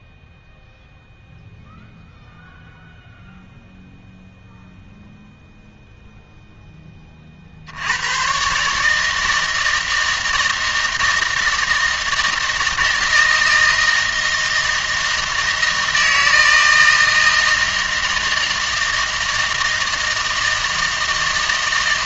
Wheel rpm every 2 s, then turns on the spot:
0, 0, 0, 10, 140, 160, 160, 160, 160, 160, 160.
none